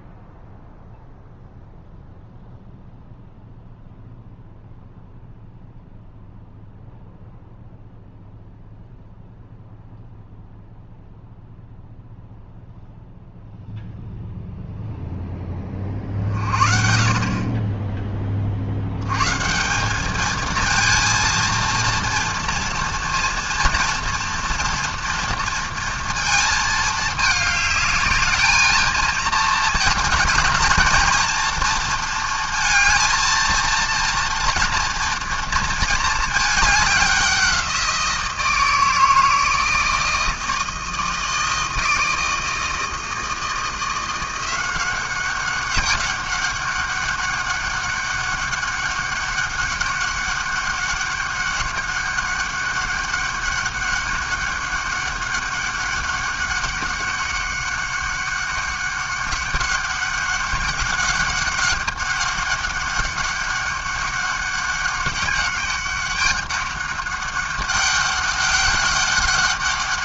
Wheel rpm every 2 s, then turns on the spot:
0, 0, 0, 0, 0, 0, 0, 10, 40, 130, 230, 230, 230, 210, 230, 230, 230, 230, 190, 160, 160, 160, 190, 200, 200, 200, 200, 200, 200, 200, 200, 200, 200, 200, 200.
none